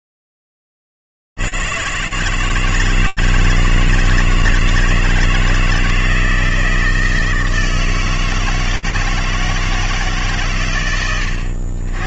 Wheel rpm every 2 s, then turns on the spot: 10, 140, 160, 160, 160, 160.
none